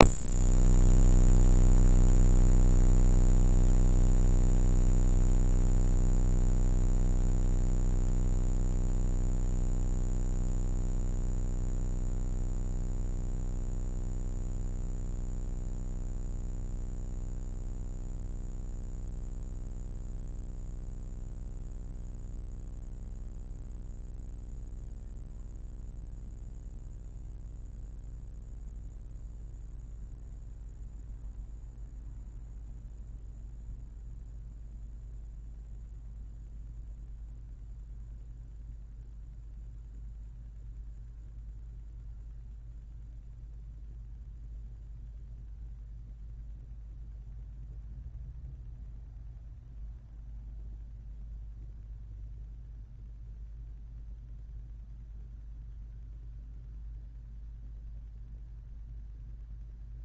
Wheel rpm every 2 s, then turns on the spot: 0, 0, 0, 0, 0, 0, 0, 0, 0, 0, 0, 0, 0, 0, 0, 0, 0, 0, 0, 0, 0, 0, 0, 0, 0, 0, 0, 0, 0, 0.
none